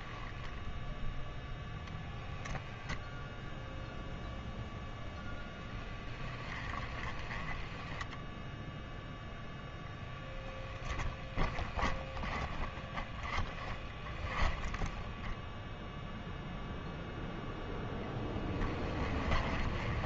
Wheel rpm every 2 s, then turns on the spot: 0, 0, 0, 10, 0, 10, 10, 10, 0, 20.
10-12